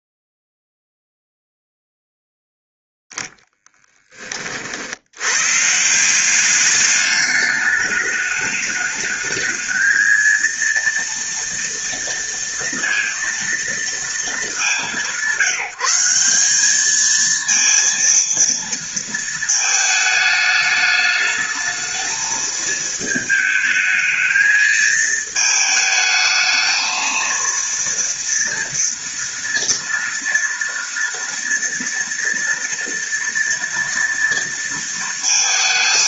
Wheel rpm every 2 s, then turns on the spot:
0, 10, 100, 210, 220, 230, 230, 170, 230, 220, 220, 220, 220, 230, 230, 230, 230, 230.
none